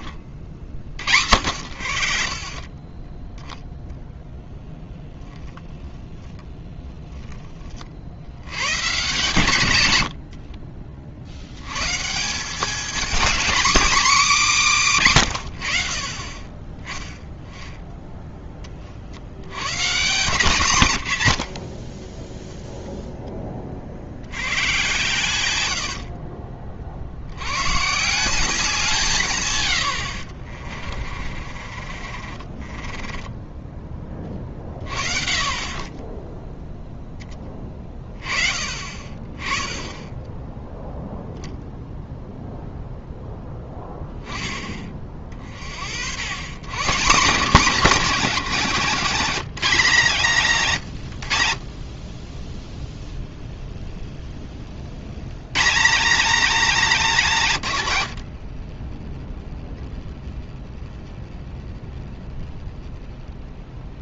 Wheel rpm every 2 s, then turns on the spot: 130, 70, 10, 0, 120, 70, 240, 160, 10, 50, 130, 0, 130, 50, 170, 30, 20, 40, 0, 40, 0, 0, 30, 170, 230, 140, 10, 60, 250, 30, 10, 10.
4-6 20-22 30-34 58-60